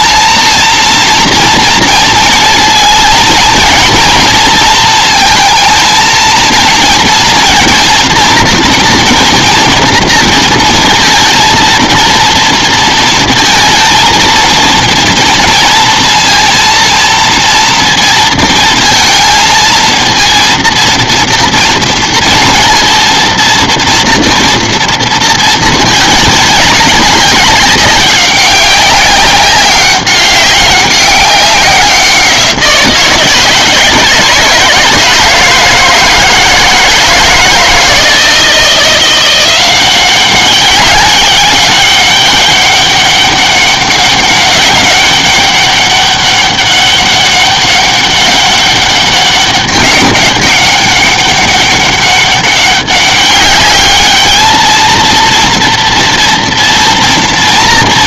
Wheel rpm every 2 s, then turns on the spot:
230, 230, 230, 220, 230, 230, 230, 230, 230, 230, 230, 230, 230, 210, 200, 200, 180, 160, 160, 160, 190, 200, 200, 200, 200, 200, 190, 210, 230.
none